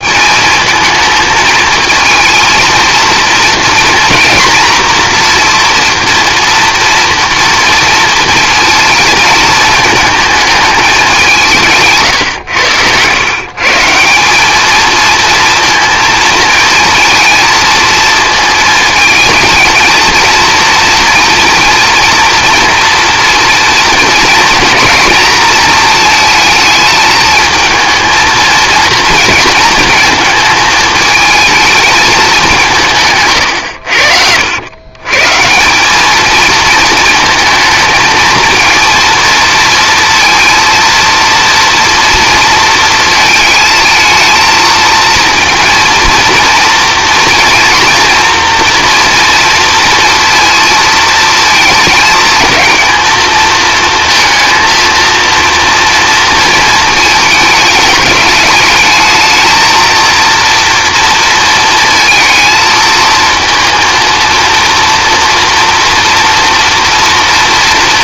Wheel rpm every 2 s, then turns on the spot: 220, 230, 230, 230, 220, 190, 120, 220, 220, 220, 230, 230, 220, 220, 230, 220, 150, 110, 220, 230, 230, 230, 230, 230, 240, 230, 230, 230, 220, 220, 230, 220, 230, 230.
none